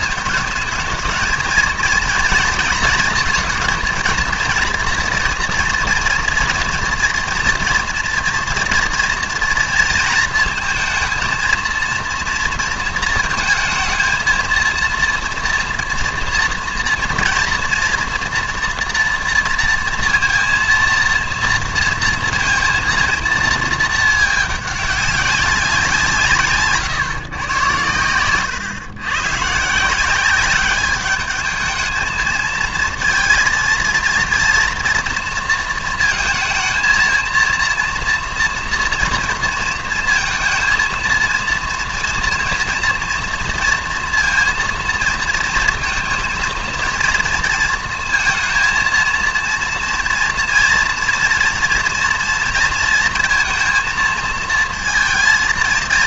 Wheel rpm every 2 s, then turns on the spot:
220, 230, 230, 230, 230, 230, 230, 230, 230, 230, 230, 230, 210, 140, 130, 200, 220, 230, 230, 230, 230, 230, 230, 230, 230, 230, 230, 230.
none